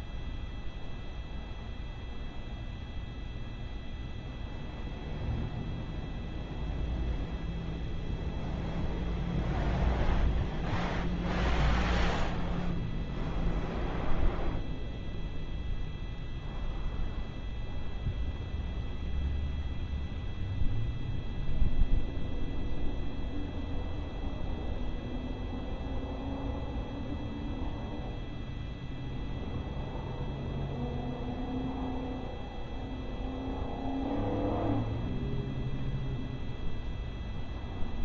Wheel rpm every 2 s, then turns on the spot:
0, 0, 0, 0, 0, 0, 0, 0, 0, 0, 0, 0, 0, 0, 0, 0, 0, 0, 0.
none